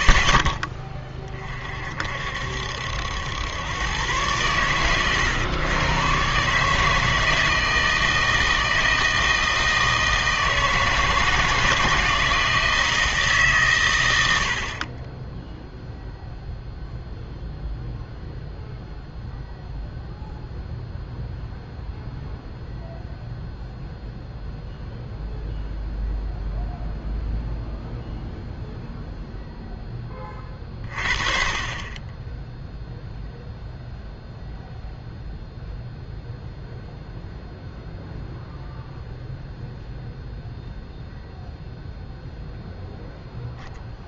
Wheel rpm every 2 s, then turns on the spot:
20, 70, 110, 150, 160, 160, 160, 50, 0, 0, 0, 0, 0, 0, 0, 30, 0, 0, 0, 0, 0, 0.
none